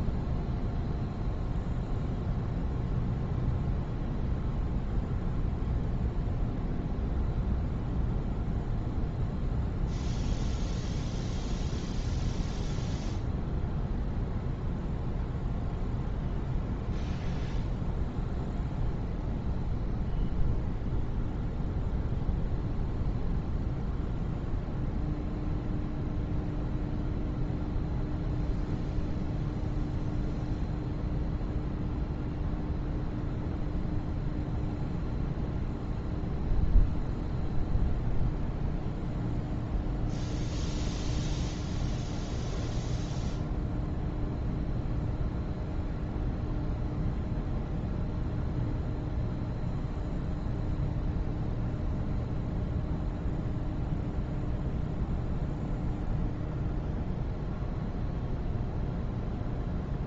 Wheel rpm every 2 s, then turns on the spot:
0, 0, 0, 0, 0, 0, 0, 0, 0, 0, 0, 0, 0, 0, 0, 0, 0, 0, 0, 0, 0, 0, 0, 0, 0, 0, 0, 0, 0, 0.
none